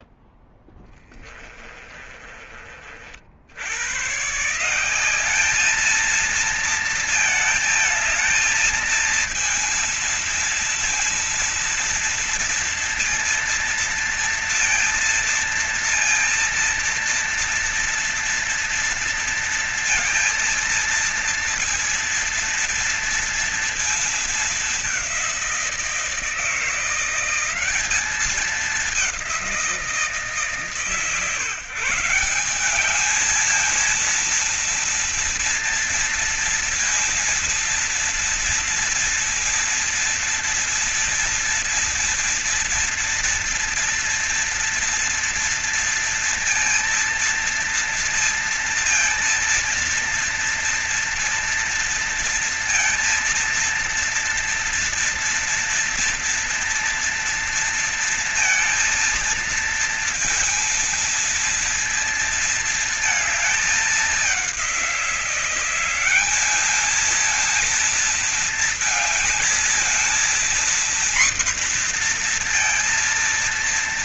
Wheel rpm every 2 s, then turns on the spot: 10, 40, 170, 230, 220, 230, 230, 230, 230, 230, 230, 230, 200, 170, 200, 140, 200, 230, 230, 230, 230, 230, 230, 230, 230, 230, 230, 230, 230, 230, 230, 230, 180, 210, 230, 240, 230.
0-2